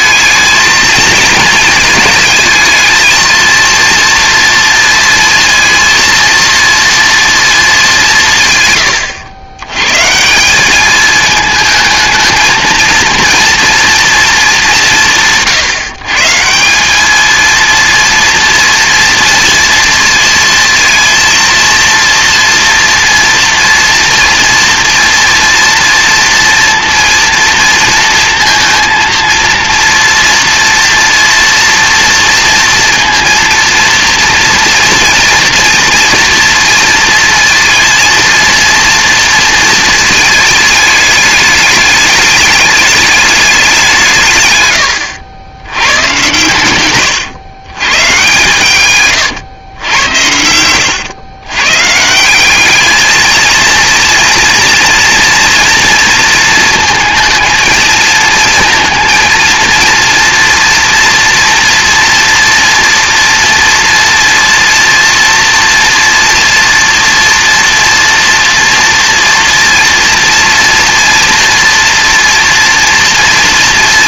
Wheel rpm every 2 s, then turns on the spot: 230, 220, 230, 230, 120, 210, 230, 190, 190, 230, 230, 230, 240, 230, 230, 230, 230, 240, 230, 230, 210, 210, 120, 120, 140, 100, 210, 230, 230, 230, 240, 240, 230, 240, 230, 230, 230.
46-48